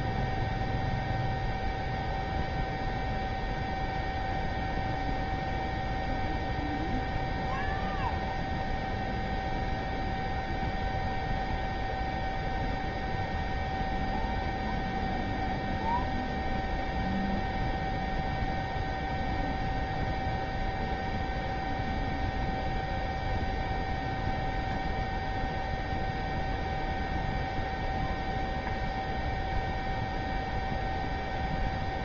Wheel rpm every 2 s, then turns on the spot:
0, 0, 0, 0, 0, 0, 0, 0, 0, 0, 0, 0, 0, 0, 0, 0.
none